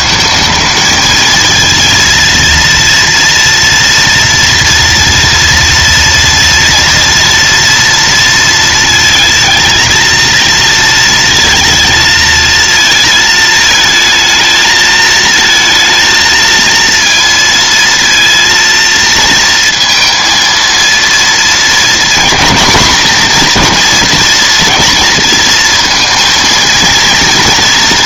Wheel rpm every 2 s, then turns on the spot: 220, 230, 230, 230, 220, 230, 230, 220, 230, 230, 230, 220, 230, 230.
none